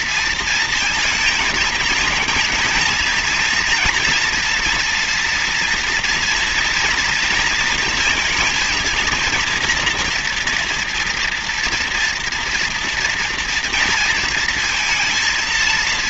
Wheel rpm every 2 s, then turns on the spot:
230, 220, 230, 240, 230, 240, 240, 230.
none